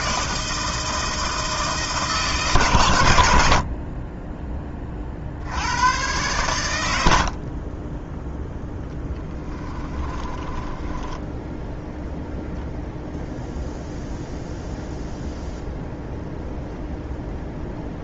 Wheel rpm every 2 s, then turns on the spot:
160, 130, 20, 100, 0, 10, 0, 0, 0.
10-12